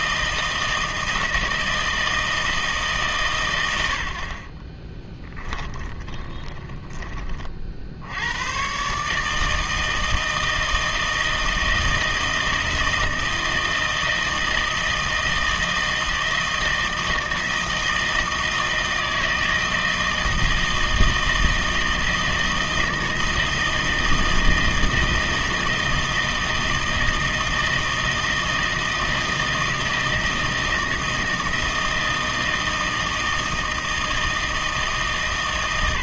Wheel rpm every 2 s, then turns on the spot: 160, 150, 20, 20, 140, 160, 160, 160, 160, 160, 160, 160, 160, 160, 160, 160, 160, 160.
4-6